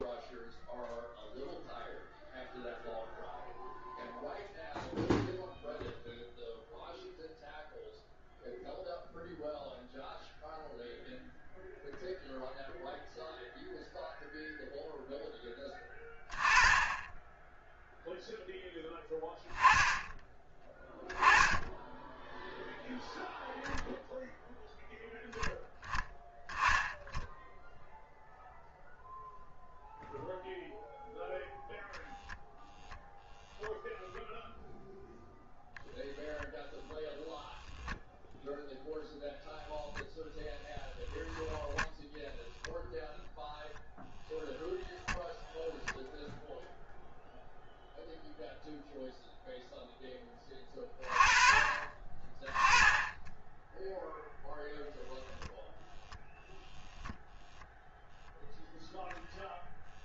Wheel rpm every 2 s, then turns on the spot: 0, 0, 0, 0, 0, 0, 0, 0, 10, 0, 10, 0, 0, 10, 0, 0, 0, 0, 0, 0, 0, 0, 0, 0, 0, 20, 10, 0, 0, 0.
none